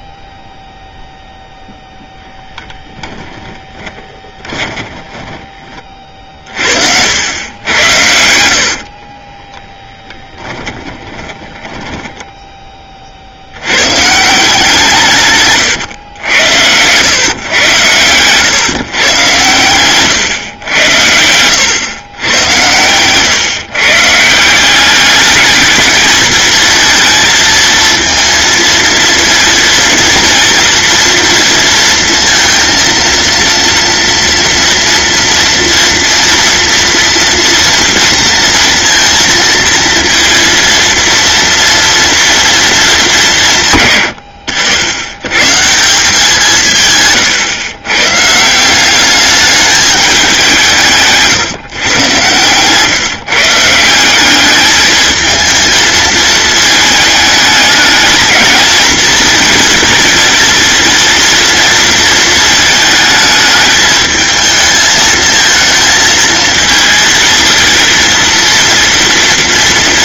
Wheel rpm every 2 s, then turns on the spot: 0, 10, 30, 80, 30, 20, 70, 140, 130, 130, 90, 130, 210, 230, 230, 230, 230, 230, 230, 230, 230, 160, 130, 120, 200, 140, 150, 220, 210, 220, 230, 210, 220, 220, 230.
2-6 8-12 14-16